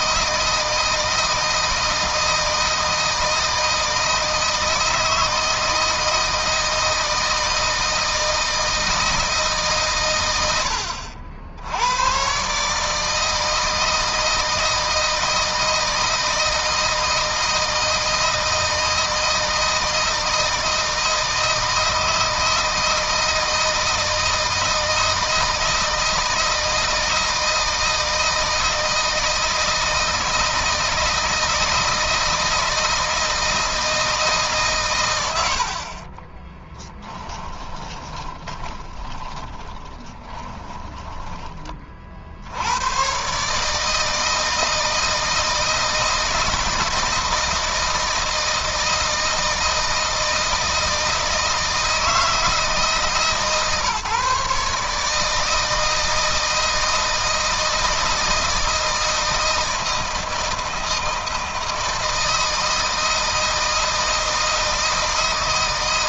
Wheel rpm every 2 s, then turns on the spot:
160, 160, 160, 160, 160, 80, 150, 160, 160, 160, 160, 170, 160, 160, 160, 160, 160, 130, 10, 30, 10, 90, 160, 160, 160, 160, 160, 150, 160, 160, 160, 160, 160.
36-42